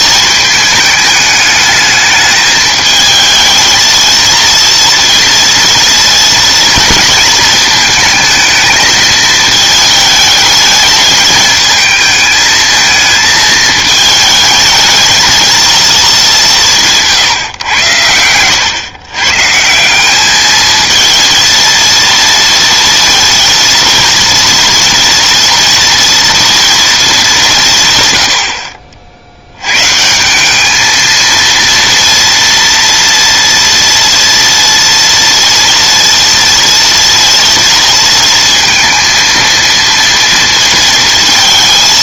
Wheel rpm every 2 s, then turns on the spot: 210, 220, 230, 230, 220, 210, 220, 220, 180, 120, 220, 230, 230, 230, 60, 210, 230, 230, 230, 230, 230.
none